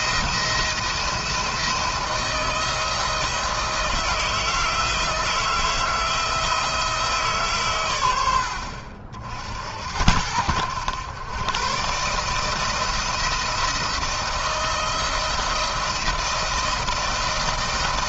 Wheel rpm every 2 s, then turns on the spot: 170, 160, 160, 160, 60, 100, 160, 160, 170.
none